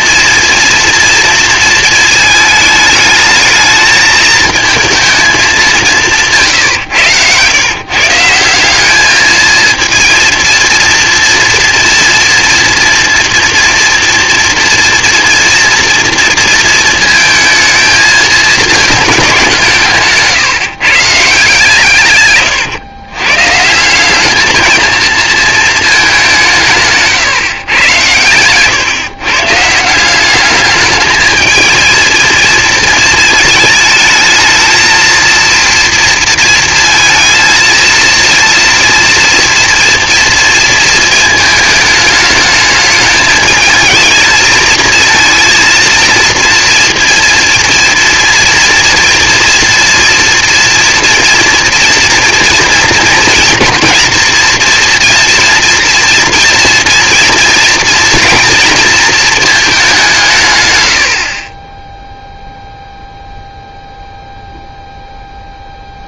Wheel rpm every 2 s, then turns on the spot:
230, 220, 220, 110, 210, 230, 230, 240, 220, 210, 140, 130, 220, 140, 130, 210, 220, 230, 230, 230, 230, 210, 220, 230, 230, 230, 230, 230, 230, 230, 70, 0, 0.
none